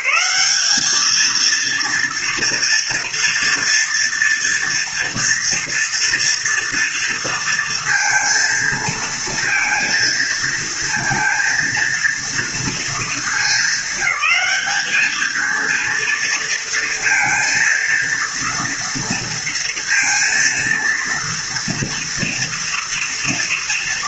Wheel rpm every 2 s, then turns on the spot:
200, 230, 230, 230, 230, 230, 230, 210, 230, 230, 230, 230.
none